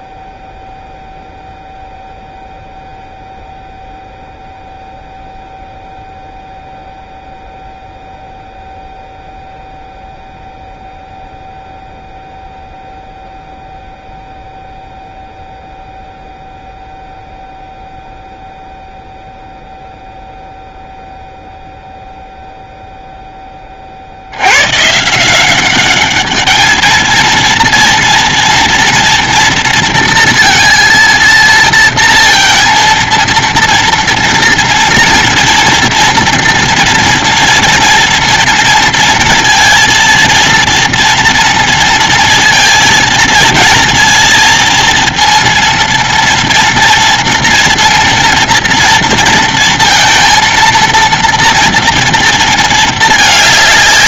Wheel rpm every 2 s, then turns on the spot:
0, 0, 0, 0, 0, 0, 0, 0, 0, 0, 0, 0, 70, 200, 230, 230, 230, 230, 230, 230, 230, 230, 230, 230, 230, 230, 230.
none